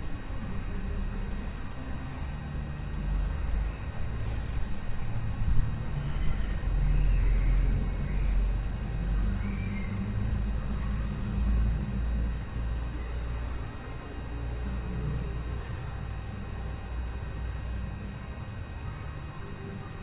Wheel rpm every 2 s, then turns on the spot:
0, 0, 0, 0, 0, 0, 0, 0, 0, 0.
none